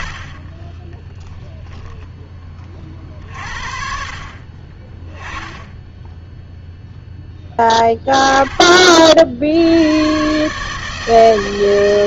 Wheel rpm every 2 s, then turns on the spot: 40, 40, 30, 0, 40, 150.
0-2